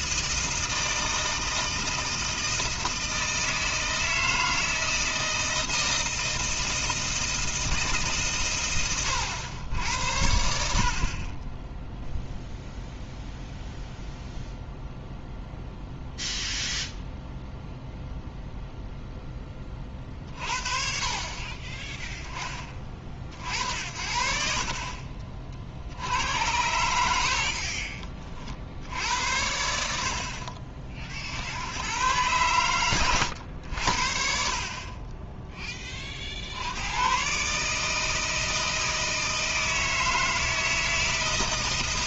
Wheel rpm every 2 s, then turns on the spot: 160, 160, 160, 160, 120, 70, 0, 0, 0, 0, 40, 10, 40, 80, 50, 50, 120, 40, 80, 160, 160.
none